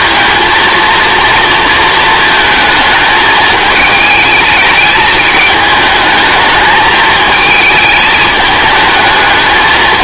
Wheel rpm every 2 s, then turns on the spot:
230, 220, 220, 210, 210.
none